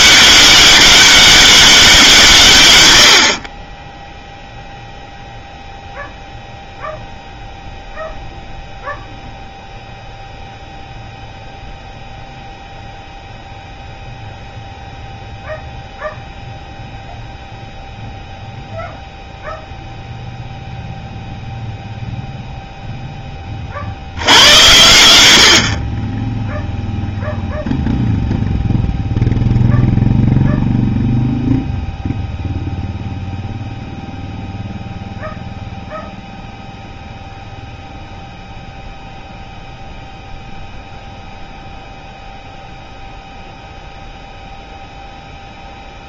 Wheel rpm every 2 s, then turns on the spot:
200, 140, 0, 0, 0, 0, 0, 0, 0, 0, 0, 0, 90, 0, 0, 0, 0, 0, 0, 0, 0, 0, 0.
none